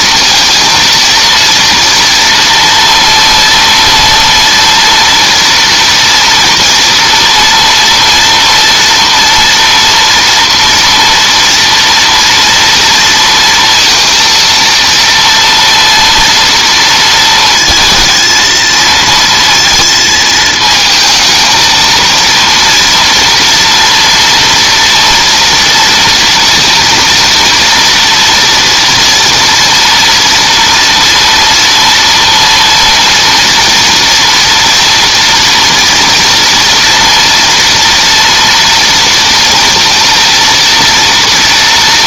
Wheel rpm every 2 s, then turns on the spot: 230, 230, 230, 230, 230, 230, 230, 230, 230, 230, 220, 230, 230, 230, 240, 230, 230, 230, 230, 230, 230.
none